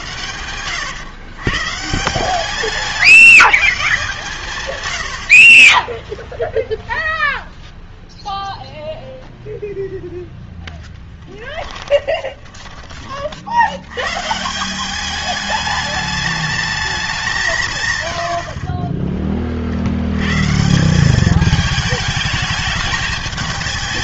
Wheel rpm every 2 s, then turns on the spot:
110, 170, 120, 0, 0, 10, 20, 180, 210, 40, 160, 210.
10-12 18-20